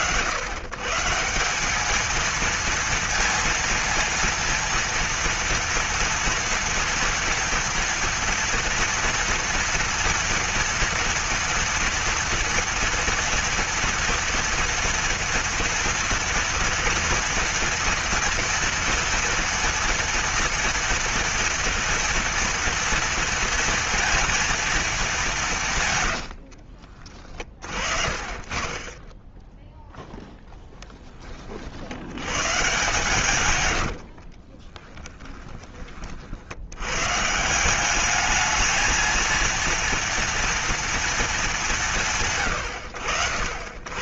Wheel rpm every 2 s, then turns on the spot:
120, 220, 230, 230, 230, 240, 240, 230, 230, 230, 240, 230, 230, 130, 60, 10, 80, 80, 30, 190, 230, 220.
26-28 34-36